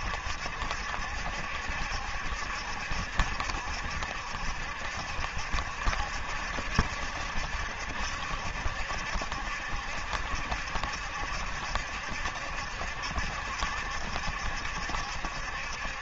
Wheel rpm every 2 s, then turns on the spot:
70, 70, 70, 70, 70, 70, 70, 70.
none